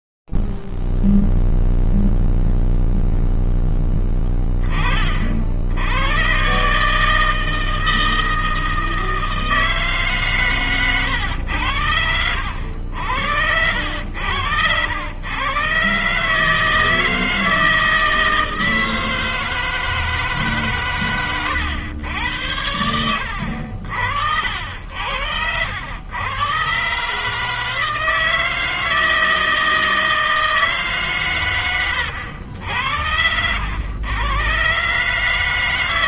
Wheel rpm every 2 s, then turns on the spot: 0, 0, 0, 40, 160, 160, 100, 80, 100, 160, 160, 110, 80, 80, 150, 160, 130, 100.
none